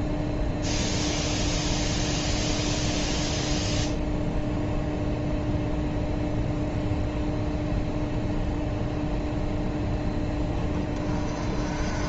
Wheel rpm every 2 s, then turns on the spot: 0, 0, 0, 0, 0, 20.
none